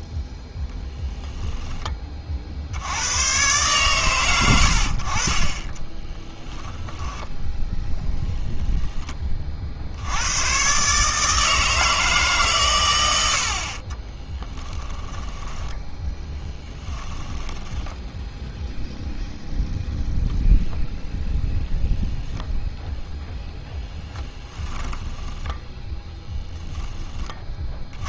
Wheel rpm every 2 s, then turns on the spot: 0, 60, 80, 10, 10, 140, 110, 10, 10, 0, 0, 0, 10, 10.
14-18 24-26